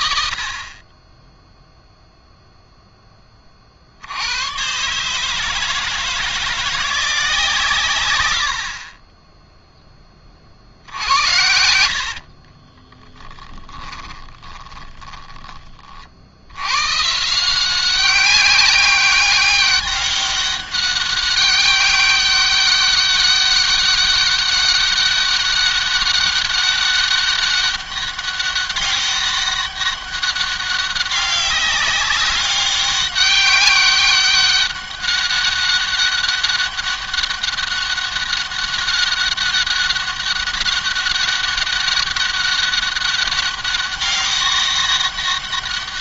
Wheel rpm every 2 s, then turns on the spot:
50, 0, 120, 170, 60, 60, 40, 20, 110, 190, 200, 200, 200, 200, 200, 200, 200, 190, 200, 200, 200, 200, 200.
10-16